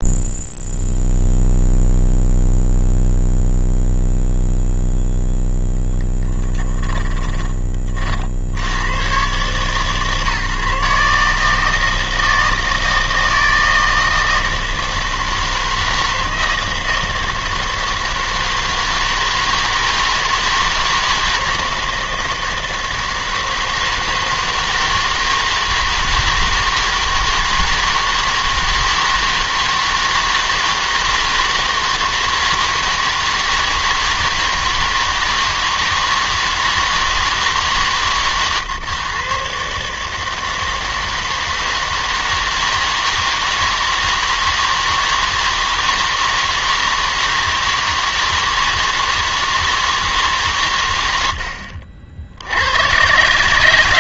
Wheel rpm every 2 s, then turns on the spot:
0, 0, 0, 10, 80, 140, 160, 160, 160, 160, 160, 160, 160, 160, 160, 160, 160, 160, 160, 130, 160, 160, 160, 160, 160, 130, 90.
6-8